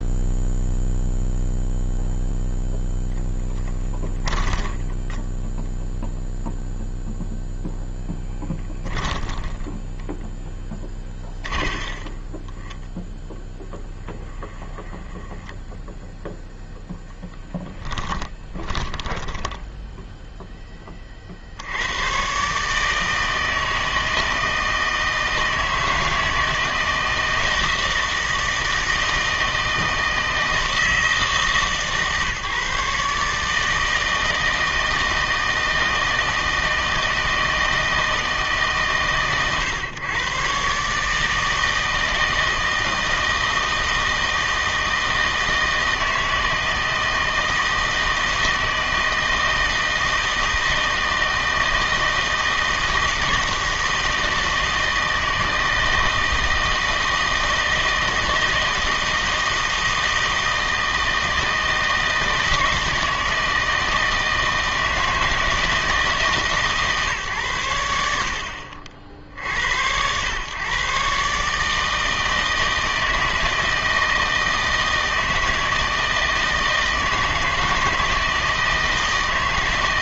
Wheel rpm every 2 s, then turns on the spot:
0, 0, 10, 0, 10, 20, 20, 20, 0, 20, 20, 150, 160, 160, 160, 160, 140, 160, 160, 140, 140, 160, 160, 160, 160, 160, 160, 160, 160, 160, 160, 160, 160, 140, 60, 130, 160, 160, 160, 160.
4-6 8-16 18-20